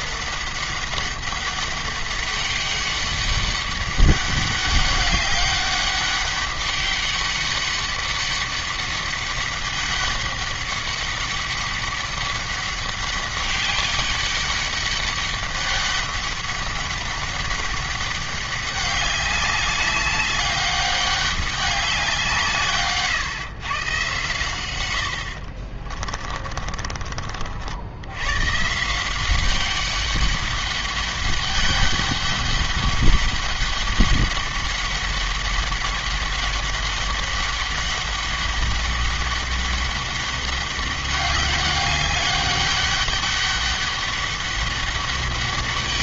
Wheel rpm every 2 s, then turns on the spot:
200, 200, 200, 200, 200, 200, 200, 200, 200, 200, 200, 150, 110, 30, 150, 200, 200, 200, 200, 200, 200, 200, 200.
26-28